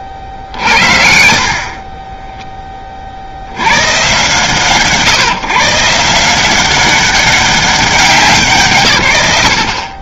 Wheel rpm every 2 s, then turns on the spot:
60, 20, 130, 190, 120.
none